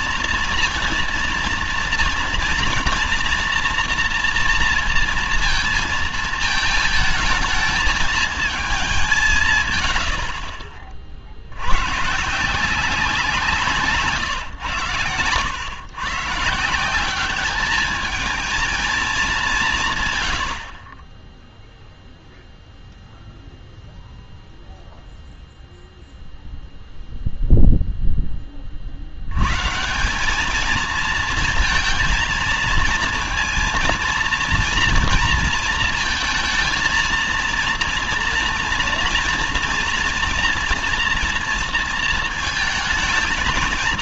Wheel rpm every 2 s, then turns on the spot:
230, 230, 230, 220, 200, 50, 170, 130, 170, 220, 50, 0, 0, 0, 50, 220, 230, 230, 220, 240, 240, 220.
none